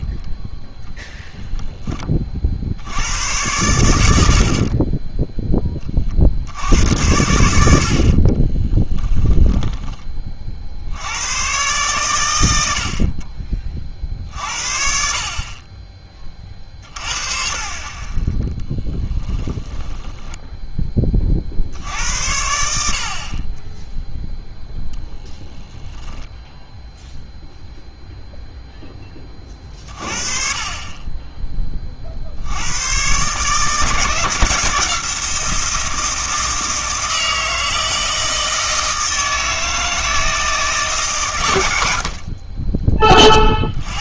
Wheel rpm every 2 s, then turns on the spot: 0, 70, 40, 80, 10, 60, 70, 50, 50, 10, 20, 70, 0, 0, 0, 30, 100, 170, 160, 160, 160, 20.
4-6 8-10 18-22 42-44